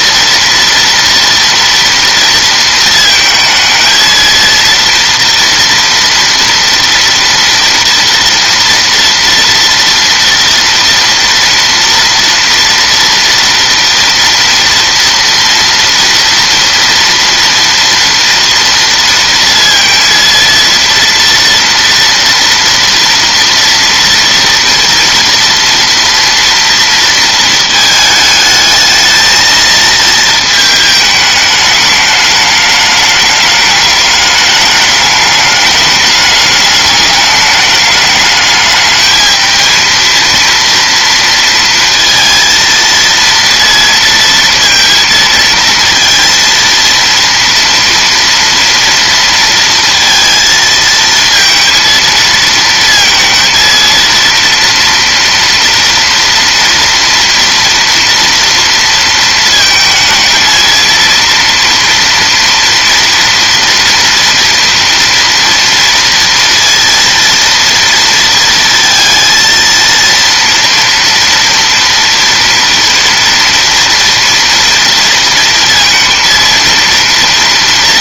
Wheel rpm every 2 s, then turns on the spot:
230, 230, 230, 230, 230, 230, 230, 230, 230, 230, 230, 230, 240, 230, 220, 220, 210, 210, 210, 210, 230, 230, 230, 230, 230, 230, 230, 230, 230, 230, 230, 230, 230, 230, 230, 230, 230, 230, 230.
none